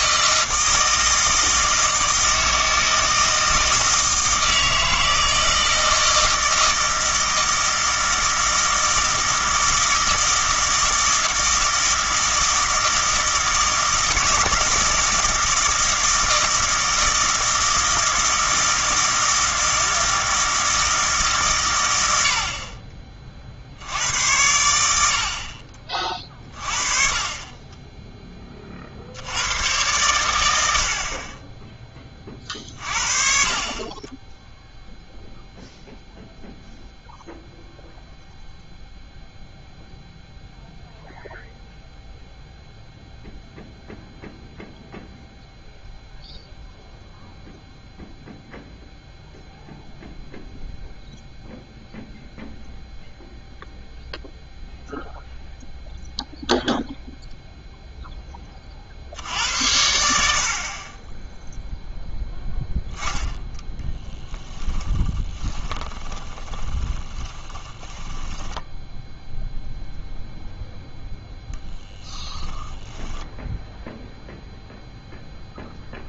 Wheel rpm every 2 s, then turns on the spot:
160, 160, 160, 160, 160, 160, 160, 160, 160, 160, 160, 50, 90, 30, 40, 70, 40, 0, 0, 0, 0, 0, 0, 0, 0, 0, 0, 0, 0, 40, 40, 10, 20, 20, 10, 0, 10, 0.
64-70 72-74